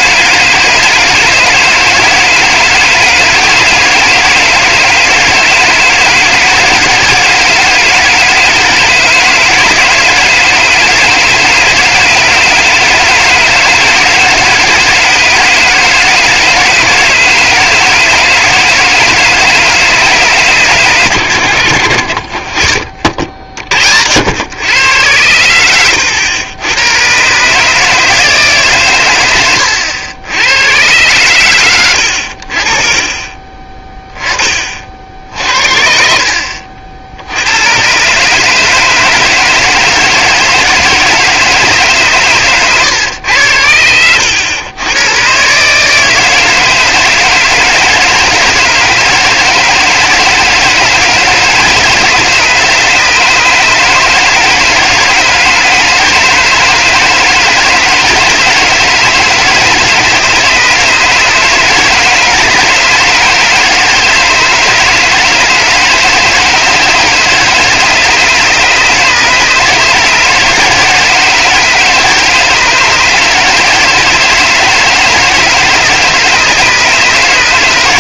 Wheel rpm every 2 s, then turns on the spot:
160, 160, 160, 160, 160, 160, 160, 160, 160, 160, 130, 50, 100, 100, 130, 100, 50, 40, 60, 150, 160, 120, 110, 160, 160, 160, 150, 150, 160, 170, 150, 160, 160, 160, 150, 160, 160, 160, 150.
42-44